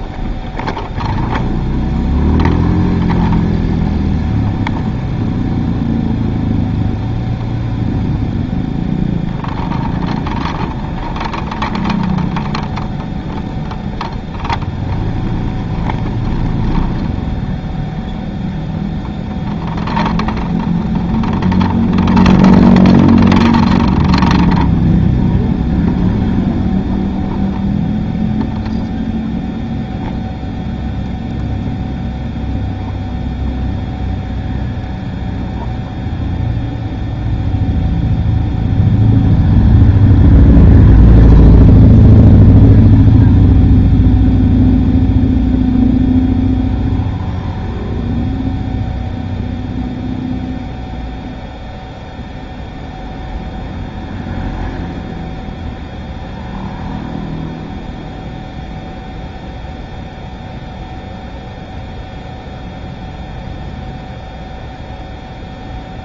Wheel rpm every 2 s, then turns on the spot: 0, 0, 0, 0, 0, 0, 0, 0, 0, 0, 0, 0, 0, 0, 0, 0, 0, 0, 0, 0, 0, 0, 0, 0, 0, 0, 0, 0, 0, 0, 0, 0, 0.
none